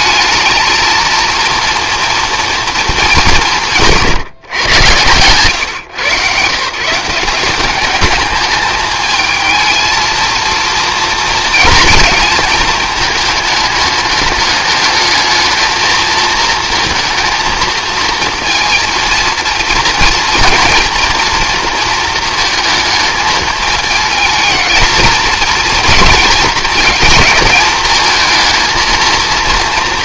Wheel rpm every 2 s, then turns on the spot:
220, 220, 130, 150, 210, 230, 220, 210, 230, 230, 230, 220, 220, 230, 230.
none